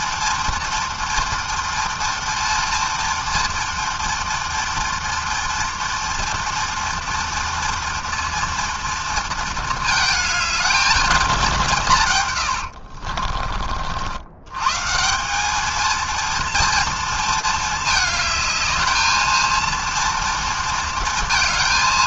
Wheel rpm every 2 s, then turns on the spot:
240, 230, 230, 230, 230, 220, 120, 120, 230, 220, 230.
12-14